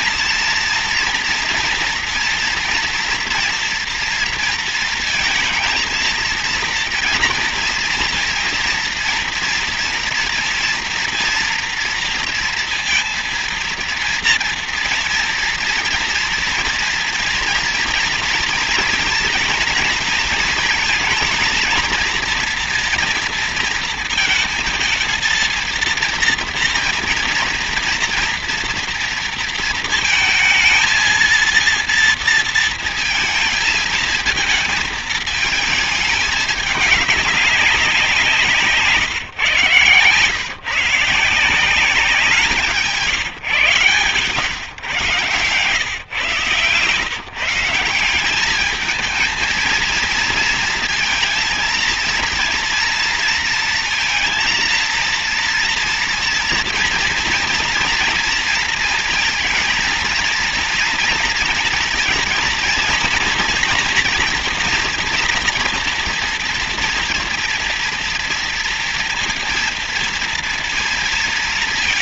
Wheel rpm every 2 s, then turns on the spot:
230, 230, 230, 230, 230, 230, 230, 230, 230, 230, 220, 230, 230, 230, 230, 220, 230, 220, 200, 150, 160, 170, 140, 150, 220, 220, 230, 230, 230, 230, 230, 230, 240, 230, 230, 230.
none